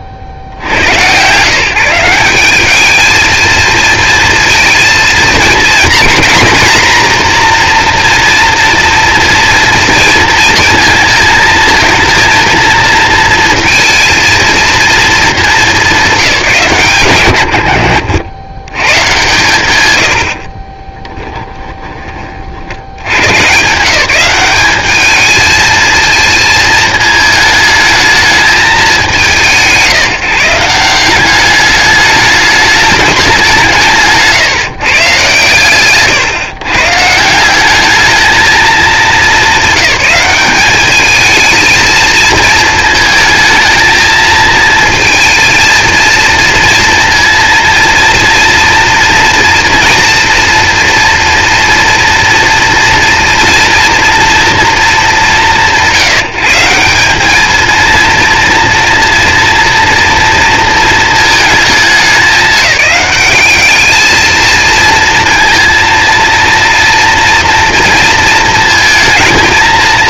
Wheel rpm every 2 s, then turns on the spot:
30, 210, 230, 250, 240, 230, 230, 230, 140, 130, 20, 70, 200, 220, 190, 170, 210, 150, 140, 220, 210, 220, 220, 230, 230, 240, 240, 230, 160, 230, 230, 210, 230, 230, 230.
20-22